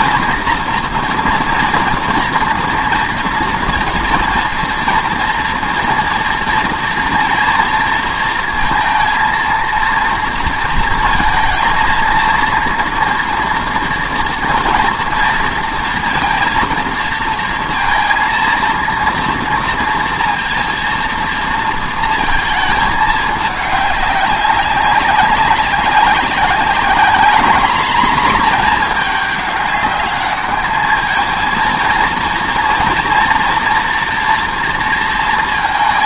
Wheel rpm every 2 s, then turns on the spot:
230, 230, 230, 230, 230, 230, 240, 230, 230, 230, 230, 220, 200, 200, 220, 210, 230, 230.
none